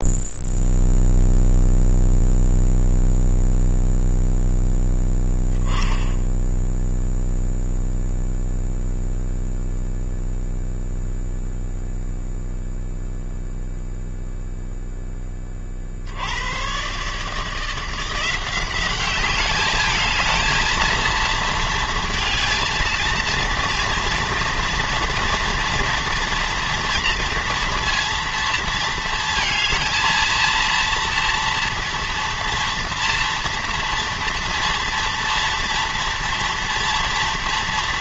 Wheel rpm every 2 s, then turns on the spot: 0, 0, 0, 10, 0, 0, 0, 0, 80, 180, 220, 230, 230, 230, 230, 230, 230, 230, 230.
none